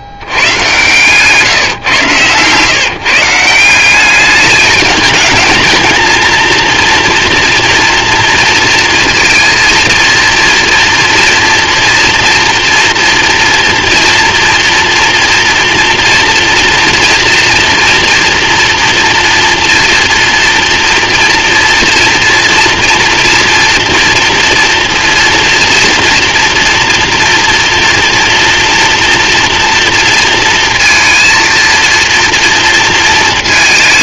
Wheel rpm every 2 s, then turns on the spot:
120, 150, 210, 230, 230, 230, 230, 230, 230, 240, 230, 230, 230, 230, 230, 230, 230.
none